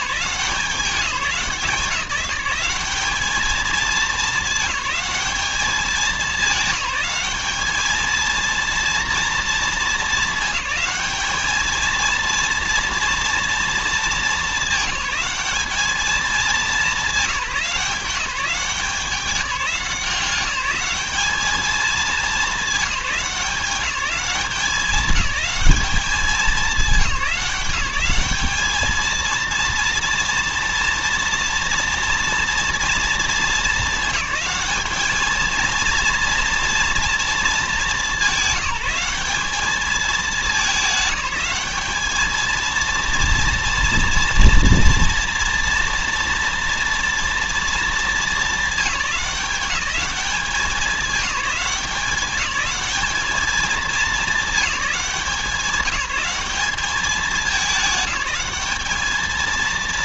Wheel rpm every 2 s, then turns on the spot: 190, 200, 210, 210, 230, 210, 230, 210, 210, 190, 200, 200, 190, 190, 210, 230, 230, 220, 230, 200, 210, 230, 240, 230, 210, 190, 210, 200, 200, 200.
none